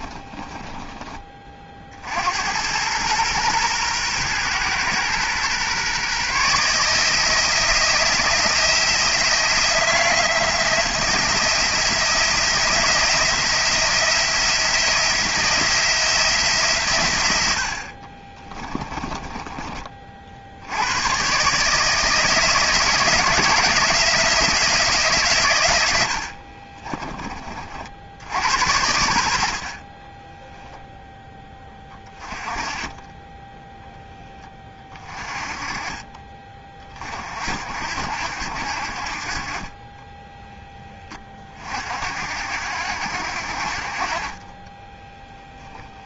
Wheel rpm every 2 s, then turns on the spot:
10, 100, 120, 160, 170, 170, 170, 170, 130, 20, 90, 170, 170, 40, 80, 0, 20, 20, 30, 60, 10, 70, 10.
0-2 18-20 26-28 44-46